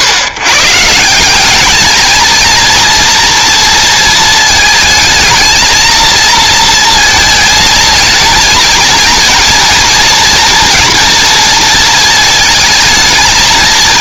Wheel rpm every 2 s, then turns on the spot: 140, 230, 220, 230, 220, 230, 220.
none